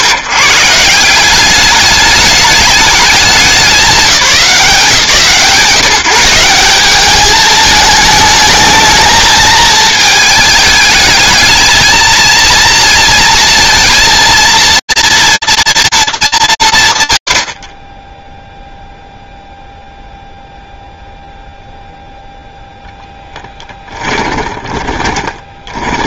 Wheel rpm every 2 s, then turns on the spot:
110, 210, 150, 190, 220, 210, 230, 230, 170, 0, 0, 0, 20.
24-26